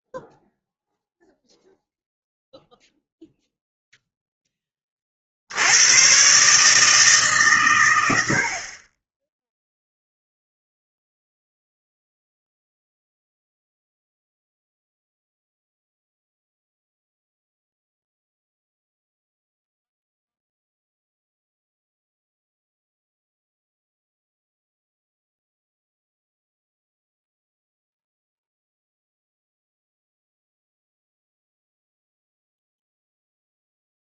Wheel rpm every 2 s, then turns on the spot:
0, 0, 0, 100, 90, 0, 0, 0, 0, 0, 0, 0, 0, 0, 0, 0, 0.
none